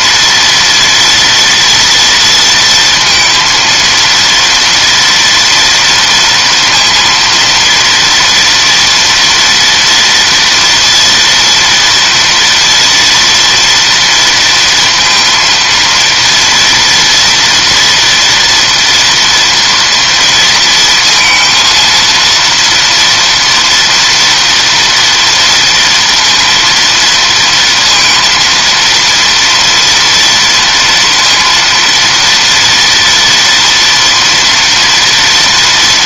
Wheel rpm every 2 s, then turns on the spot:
230, 230, 230, 230, 230, 230, 230, 230, 230, 230, 230, 230, 230, 230, 230, 230, 230, 240.
none